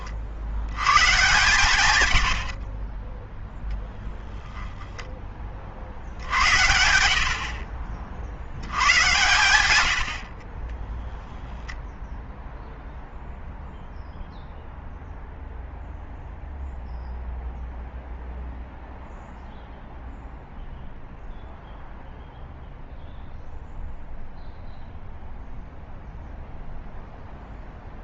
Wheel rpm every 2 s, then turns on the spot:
80, 50, 0, 80, 90, 20, 0, 0, 0, 0, 0, 0, 0, 0.
2-4